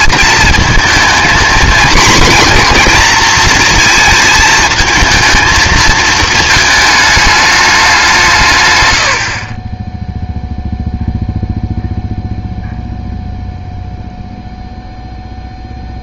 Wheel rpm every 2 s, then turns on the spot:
230, 240, 220, 220, 120, 0, 0, 0.
none